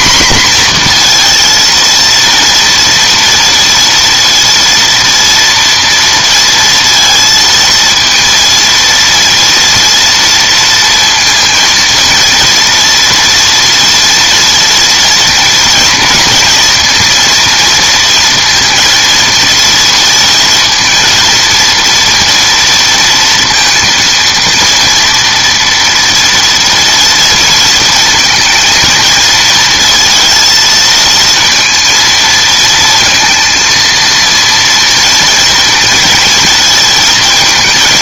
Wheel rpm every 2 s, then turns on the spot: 230, 230, 230, 230, 230, 230, 230, 230, 230, 230, 230, 230, 230, 230, 230, 230, 230, 230, 220.
none